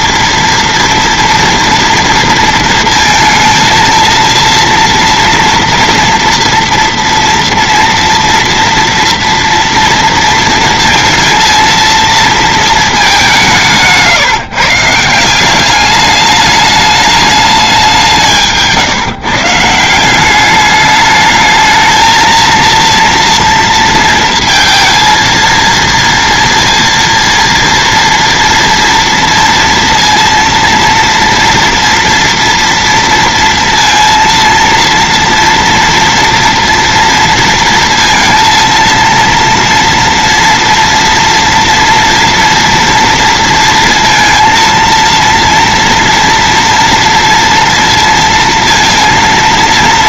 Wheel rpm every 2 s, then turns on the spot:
230, 230, 230, 230, 230, 230, 220, 150, 210, 150, 200, 230, 230, 230, 230, 230, 230, 230, 230, 230, 230, 230, 230, 230, 230.
none